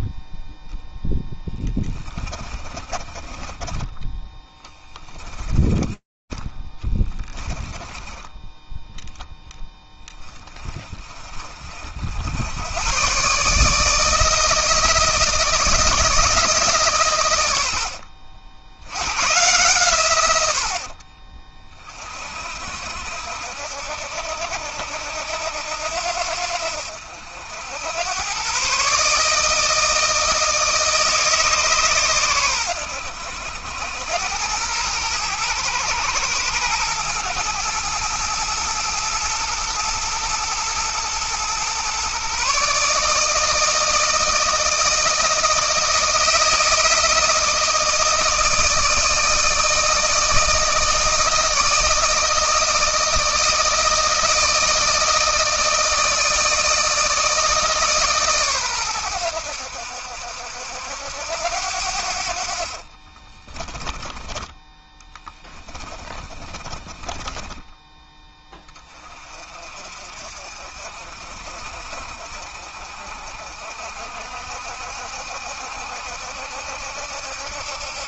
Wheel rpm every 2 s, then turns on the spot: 10, 30, 20, 20, 0, 30, 140, 160, 110, 110, 40, 70, 80, 70, 150, 150, 90, 110, 110, 110, 120, 150, 160, 160, 160, 160, 160, 160, 160, 100, 80, 40, 20, 20, 30, 50, 50, 70, 70.
2-8 20-22 62-68